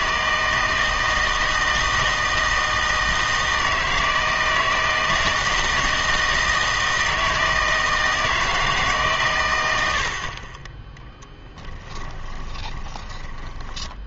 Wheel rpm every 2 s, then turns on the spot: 160, 160, 160, 160, 160, 20, 20.
12-14